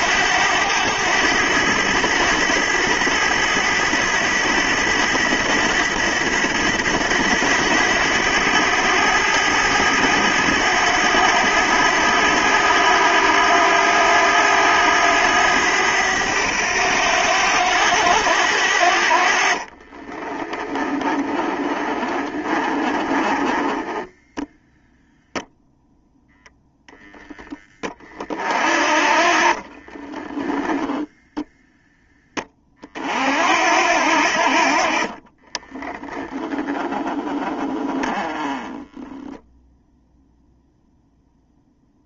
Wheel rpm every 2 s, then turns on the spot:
100, 100, 100, 100, 100, 100, 90, 100, 100, 70, 30, 30, 0, 0, 40, 0, 40, 40, 10, 10, 0.
20-24 28-30